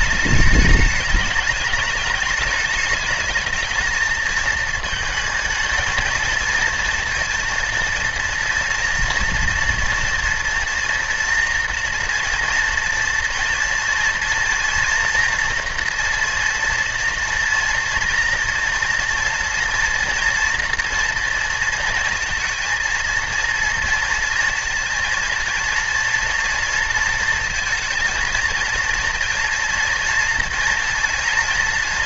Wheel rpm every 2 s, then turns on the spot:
220, 210, 220, 230, 230, 230, 240, 230, 230, 230, 230, 230, 230, 230, 230, 240.
none